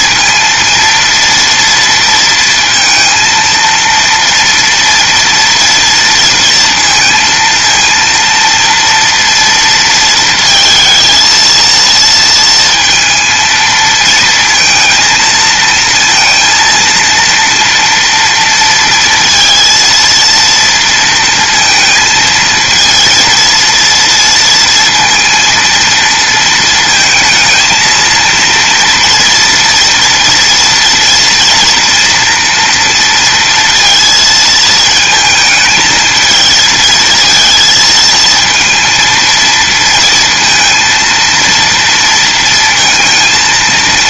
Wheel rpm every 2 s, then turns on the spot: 230, 230, 230, 230, 230, 230, 230, 220, 230, 230, 230, 230, 230, 230, 230, 230, 230, 220, 230, 230, 230, 230.
none